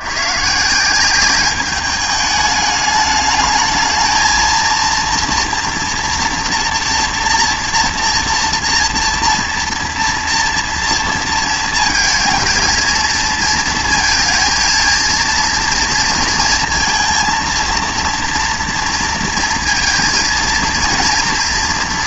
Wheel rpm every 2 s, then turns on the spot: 160, 210, 220, 230, 230, 230, 220, 220, 230, 230, 230.
none